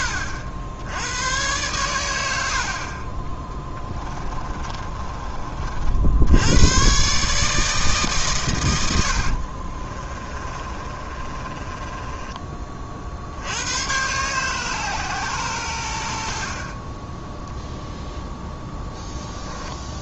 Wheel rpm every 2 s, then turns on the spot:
80, 40, 30, 120, 90, 30, 50, 140, 20, 10.
4-6 8-12 18-20